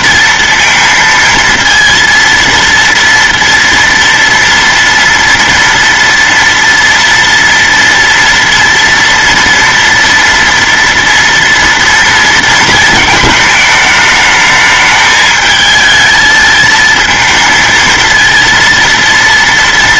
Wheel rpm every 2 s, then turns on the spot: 230, 230, 240, 230, 230, 230, 220, 220, 220, 230.
none